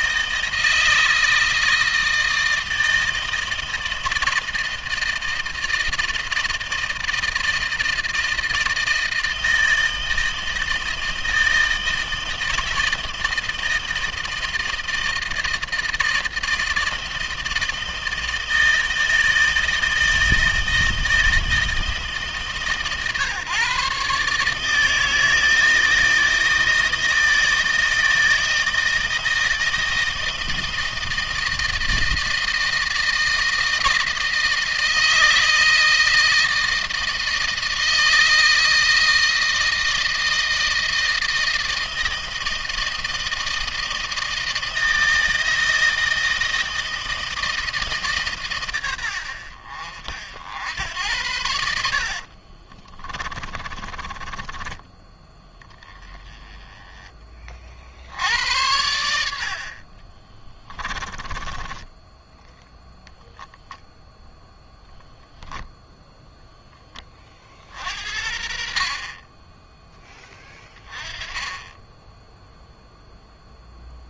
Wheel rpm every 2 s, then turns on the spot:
160, 160, 160, 160, 160, 160, 160, 160, 160, 160, 160, 150, 160, 160, 160, 160, 160, 160, 160, 160, 160, 160, 160, 160, 110, 80, 30, 20, 20, 90, 20, 0, 0, 20, 40, 20, 0.
52-54 60-62